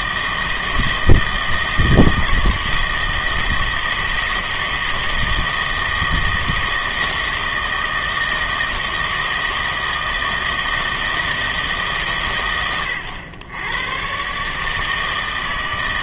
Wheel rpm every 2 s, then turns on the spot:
160, 160, 160, 160, 160, 160, 110, 150.
none